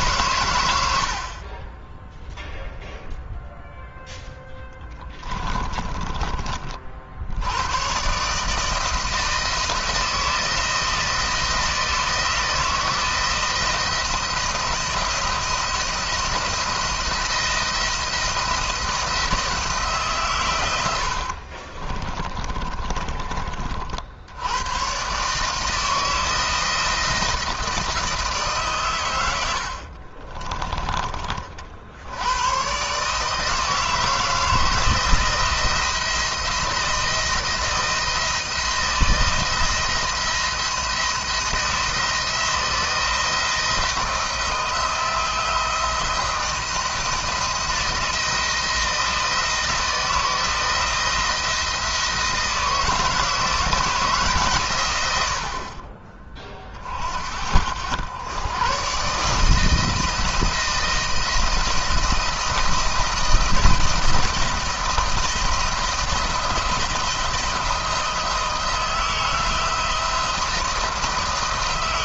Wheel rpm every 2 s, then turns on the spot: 80, 0, 20, 50, 160, 170, 160, 170, 170, 170, 90, 30, 120, 160, 120, 20, 130, 170, 160, 170, 170, 160, 170, 170, 170, 160, 160, 120, 50, 130, 170, 170, 170, 170, 160, 160.
4-6 22-24